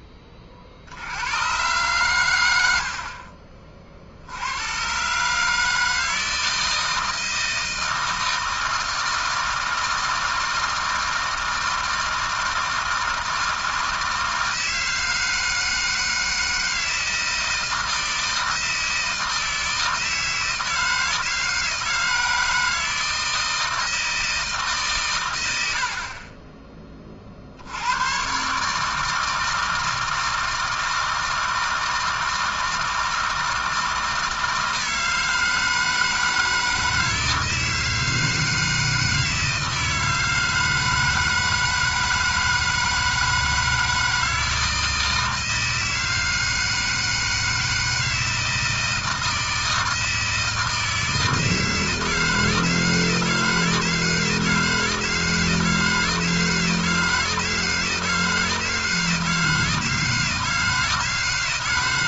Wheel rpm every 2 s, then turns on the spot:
70, 40, 130, 160, 160, 160, 160, 160, 160, 160, 160, 160, 140, 40, 160, 160, 160, 160, 160, 160, 160, 160, 160, 160, 160, 160, 160, 160, 160, 160, 160.
none